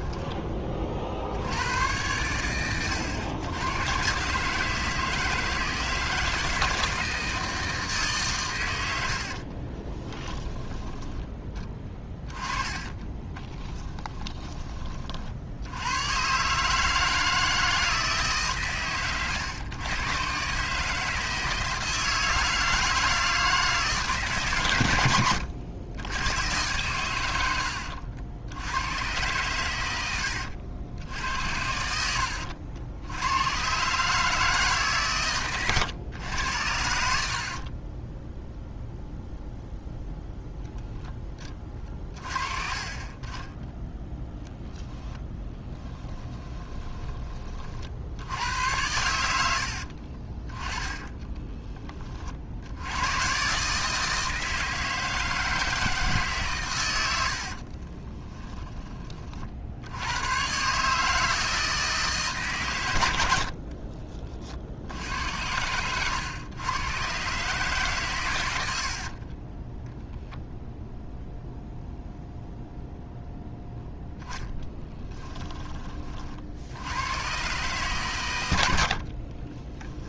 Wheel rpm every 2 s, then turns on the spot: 40, 100, 160, 160, 90, 10, 20, 30, 150, 130, 150, 160, 110, 110, 100, 80, 80, 140, 70, 0, 10, 30, 0, 20, 90, 20, 90, 160, 110, 30, 140, 110, 70, 120, 70, 0, 0, 10, 80, 70.
12-14 26-28 50-52 74-76